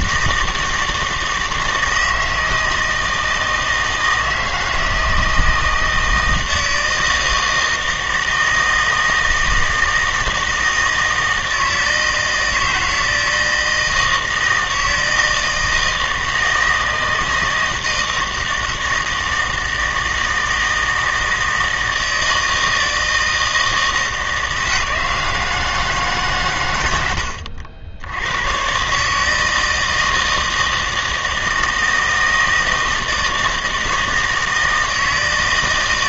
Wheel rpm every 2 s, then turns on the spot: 160, 160, 160, 160, 160, 160, 160, 160, 160, 160, 160, 160, 160, 120, 120, 160, 160, 160.
none